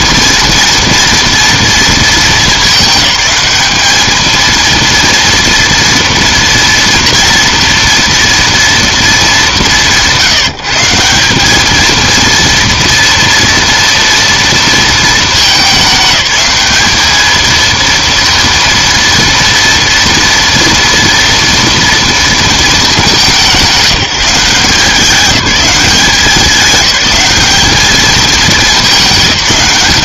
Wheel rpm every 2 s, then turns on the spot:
230, 210, 230, 230, 230, 170, 230, 230, 210, 230, 230, 210, 180, 190, 210.
none